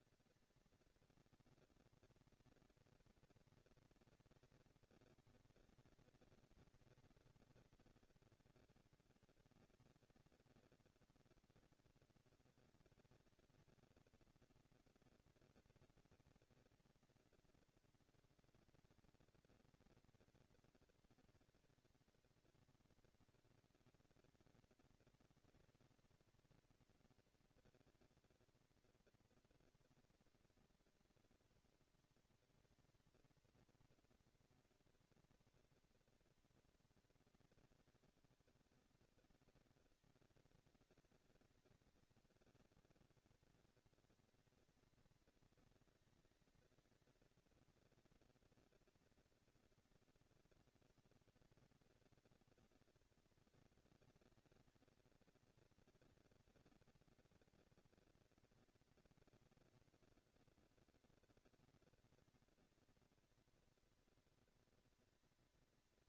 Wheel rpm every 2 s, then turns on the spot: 230, 230, 210, 200, 210, 230, 230, 230, 230, 230, 230, 230, 230, 230, 230, 230, 220, 230, 230, 200, 190, 210, 230, 230, 230, 230, 230, 230, 230, 230, 230, 230, 230.
none